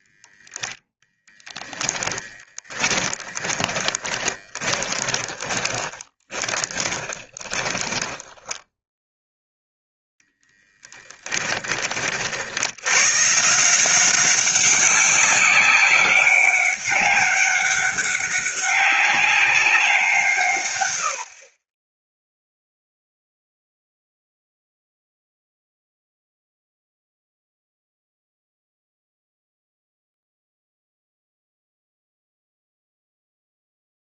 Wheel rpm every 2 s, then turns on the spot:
0, 10, 20, 20, 10, 10, 90, 190, 200, 200, 100, 0, 0, 0, 0, 0, 0.
2-8 10-12